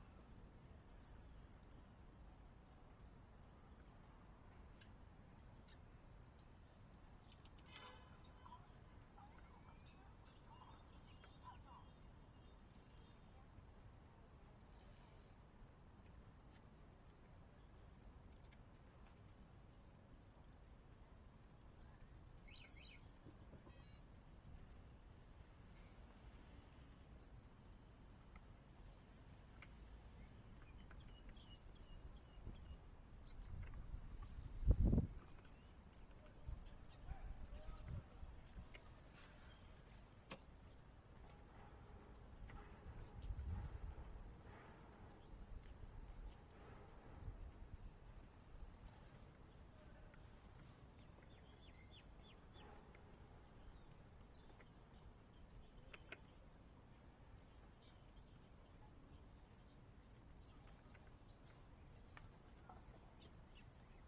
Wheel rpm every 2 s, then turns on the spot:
0, 0, 0, 0, 0, 0, 0, 0, 0, 0, 0, 0, 0, 0, 0, 0, 0, 0, 0, 0, 0, 0, 0, 0, 0, 0, 0, 0, 0, 0, 0, 0.
none